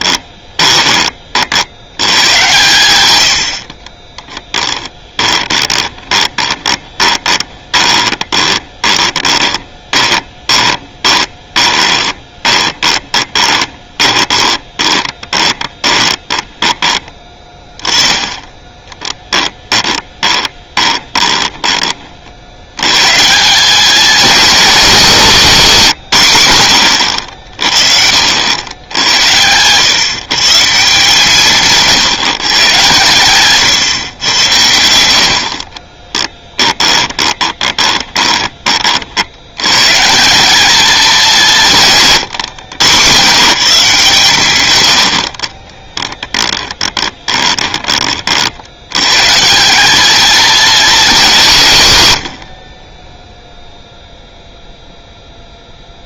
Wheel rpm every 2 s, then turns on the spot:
20, 120, 10, 20, 20, 10, 20, 20, 20, 20, 20, 100, 220, 100, 90, 160, 140, 90, 20, 30, 210, 120, 110, 20, 80, 230, 50, 0.
0-2 4-16 18-22 36-38 46-48